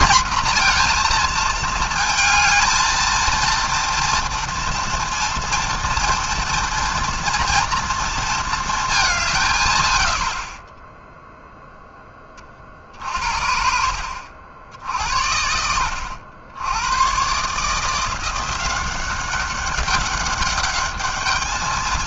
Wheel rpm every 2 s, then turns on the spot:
230, 220, 230, 230, 220, 30, 50, 70, 100, 180, 210.
none